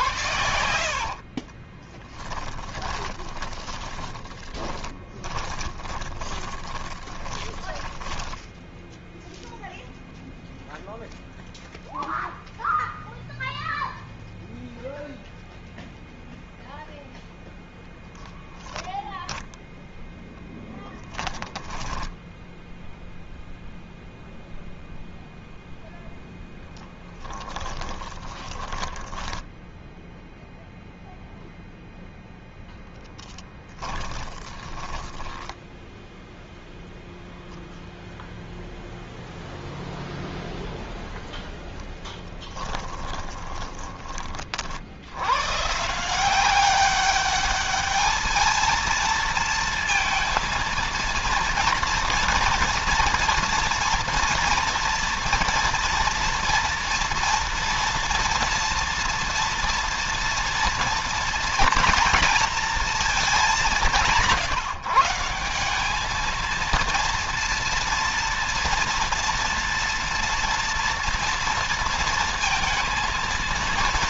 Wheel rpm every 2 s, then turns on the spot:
60, 20, 20, 20, 0, 0, 0, 0, 0, 10, 10, 0, 0, 10, 10, 0, 0, 10, 0, 0, 0, 20, 70, 200, 230, 230, 230, 230, 230, 230, 230, 220, 170, 230, 230, 230, 230.
0-8 26-30 34-36 42-44